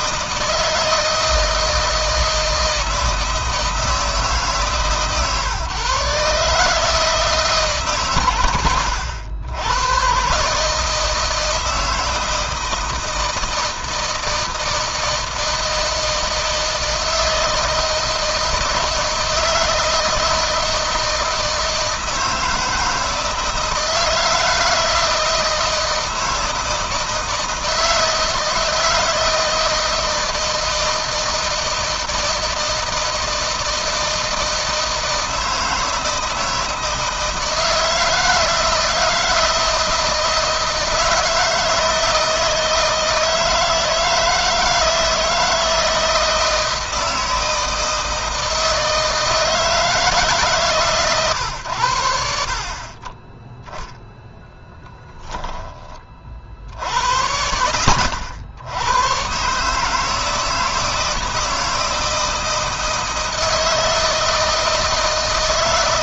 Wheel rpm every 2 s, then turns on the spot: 160, 160, 150, 150, 110, 150, 160, 160, 160, 160, 160, 160, 160, 160, 160, 160, 160, 160, 160, 160, 160, 160, 160, 160, 160, 150, 40, 10, 70, 110, 160, 160, 160.
54-56